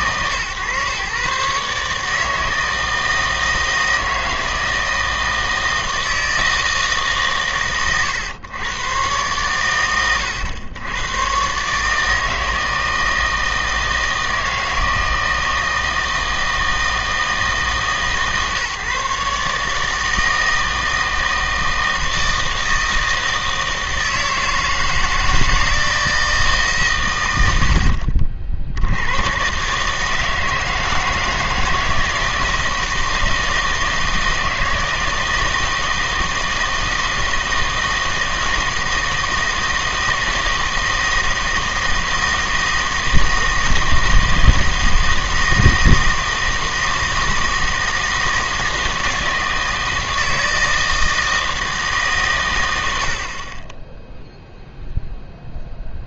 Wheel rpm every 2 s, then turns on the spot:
120, 160, 160, 160, 110, 100, 160, 160, 160, 140, 160, 160, 160, 150, 80, 160, 160, 160, 160, 160, 160, 160, 160, 160, 160, 160, 90, 0.
none